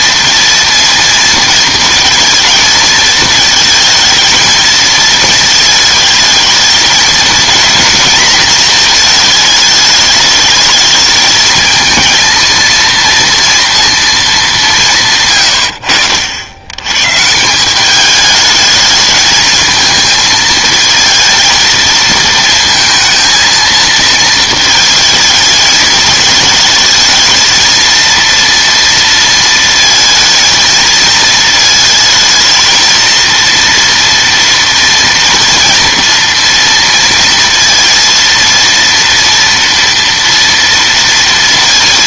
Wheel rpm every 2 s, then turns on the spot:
230, 220, 220, 220, 230, 210, 230, 200, 90, 210, 220, 220, 220, 220, 230, 230, 220, 230, 230, 230, 230.
none